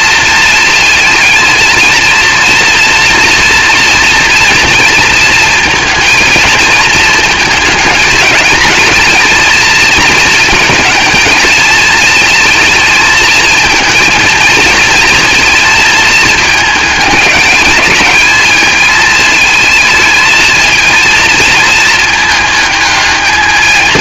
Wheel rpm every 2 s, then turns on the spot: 230, 230, 230, 220, 220, 220, 220, 230, 220, 220, 220, 220.
none